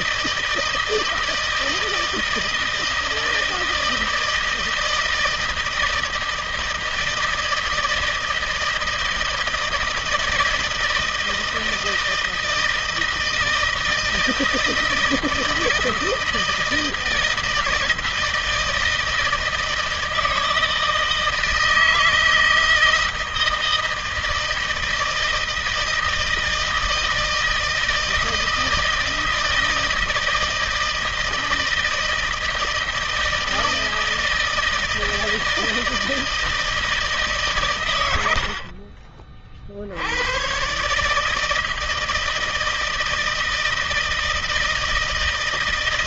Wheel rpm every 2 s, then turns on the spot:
160, 160, 160, 160, 160, 160, 160, 160, 160, 160, 160, 160, 160, 160, 160, 160, 160, 160, 160, 50, 140, 160, 160.
38-40